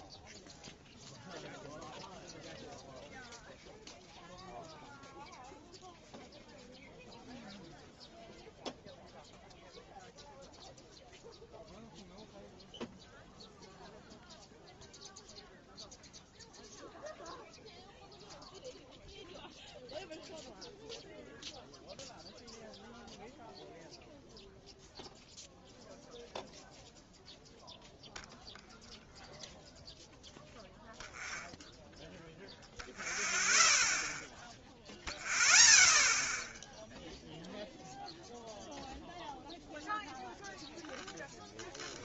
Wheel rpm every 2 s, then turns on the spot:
0, 0, 0, 0, 0, 0, 0, 0, 0, 0, 0, 0, 0, 0, 0, 0, 0, 0, 0, 0, 0.
none